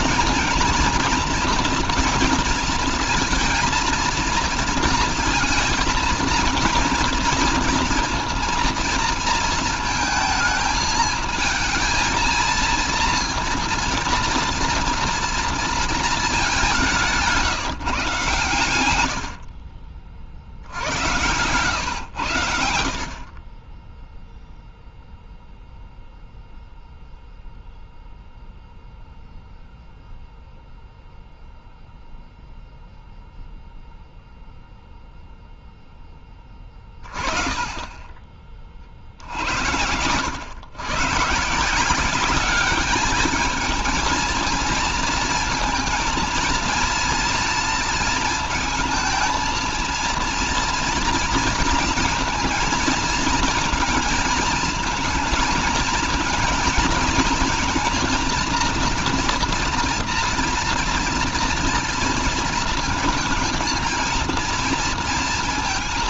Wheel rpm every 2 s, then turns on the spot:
230, 230, 230, 230, 230, 230, 230, 230, 180, 90, 80, 70, 0, 0, 0, 0, 0, 0, 20, 50, 120, 210, 230, 230, 220, 230, 230, 230, 220, 230, 230, 230, 230.
none